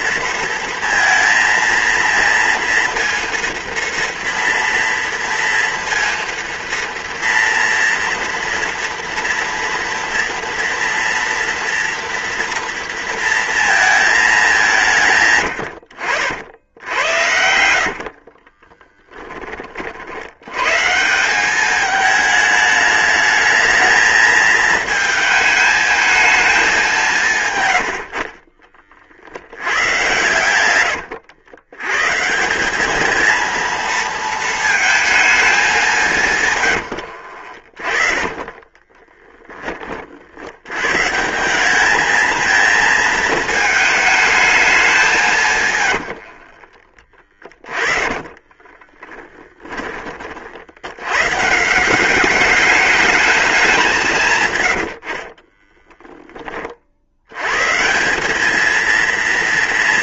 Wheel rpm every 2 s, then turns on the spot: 230, 230, 230, 230, 230, 230, 230, 150, 80, 20, 150, 210, 220, 180, 40, 100, 220, 220, 100, 20, 130, 220, 180, 20, 20, 90, 210, 80, 70, 230.
16-20 36-40 46-50 54-56